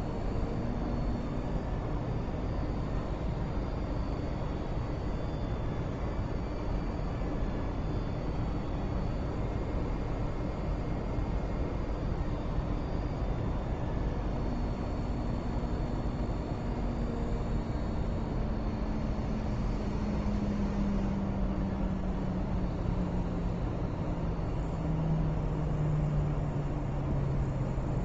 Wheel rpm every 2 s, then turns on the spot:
0, 0, 0, 0, 0, 0, 0, 0, 0, 0, 0, 0, 0, 0.
none